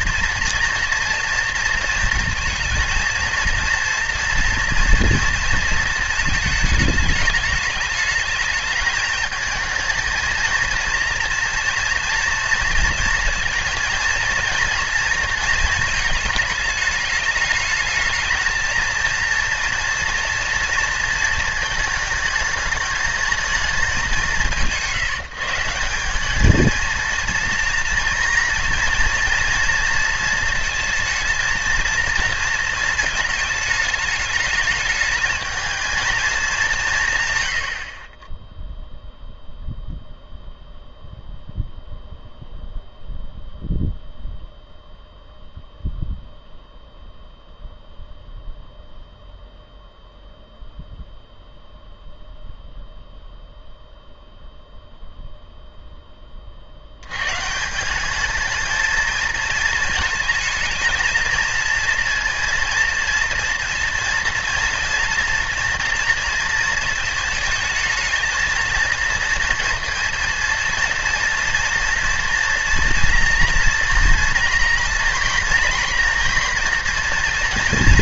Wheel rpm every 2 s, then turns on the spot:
240, 230, 230, 210, 220, 230, 230, 230, 210, 230, 230, 210, 160, 220, 230, 230, 230, 210, 190, 0, 0, 0, 0, 0, 0, 0, 0, 0, 70, 220, 220, 230, 230, 230, 230, 230, 230, 230, 240.
none